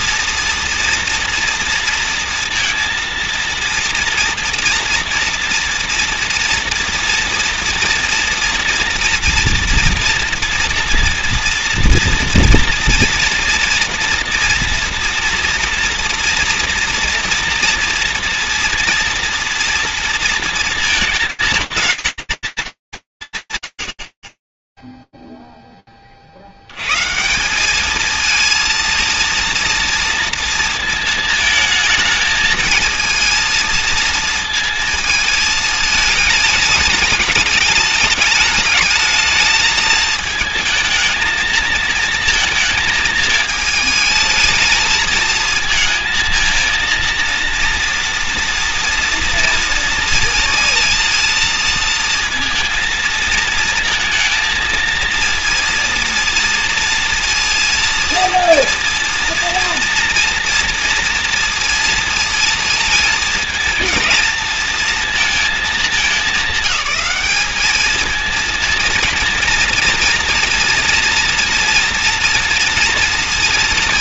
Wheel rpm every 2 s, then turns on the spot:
230, 230, 230, 230, 230, 230, 230, 240, 230, 240, 220, 230, 30, 80, 220, 230, 230, 220, 220, 220, 220, 220, 220, 220, 240, 230, 230, 230, 240, 230, 230, 230, 230, 210, 220, 230, 230.
none